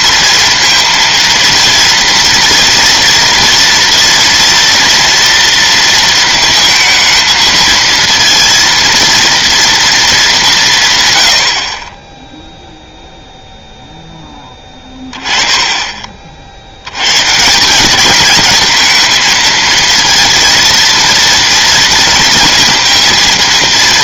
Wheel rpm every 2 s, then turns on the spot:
230, 230, 240, 230, 230, 180, 0, 20, 70, 220, 230, 230.
none